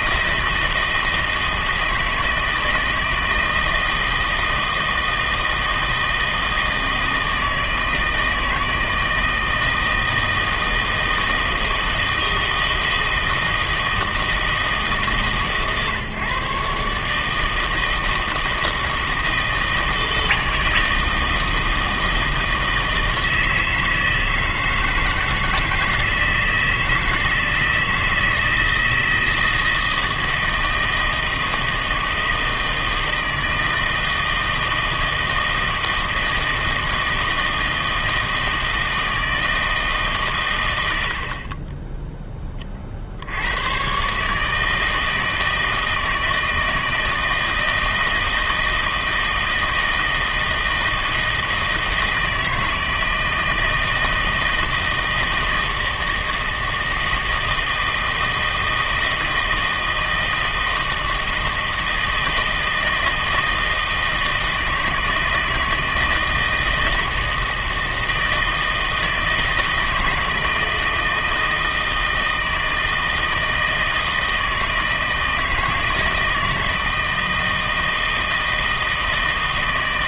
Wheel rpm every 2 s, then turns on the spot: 160, 160, 160, 160, 160, 160, 160, 150, 140, 160, 160, 160, 160, 160, 160, 160, 160, 160, 160, 160, 110, 20, 150, 160, 160, 160, 160, 160, 160, 160, 160, 160, 160, 160, 160, 160, 160, 160, 160, 160.
none